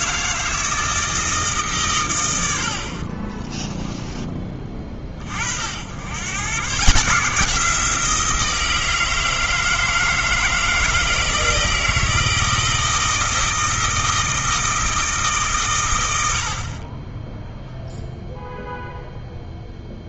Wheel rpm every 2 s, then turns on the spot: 160, 60, 30, 150, 160, 160, 170, 160, 30, 0.
2-4